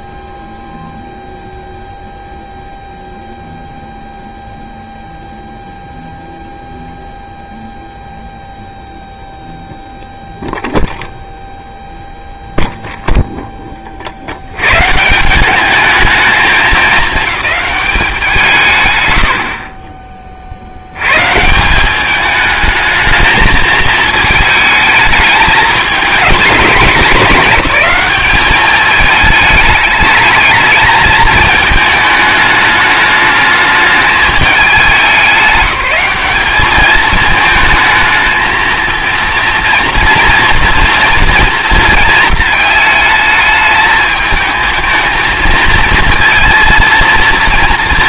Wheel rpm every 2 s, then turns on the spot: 0, 0, 0, 0, 0, 0, 0, 100, 210, 140, 50, 220, 220, 220, 210, 220, 210, 210, 210, 220, 230, 220, 220, 230.
none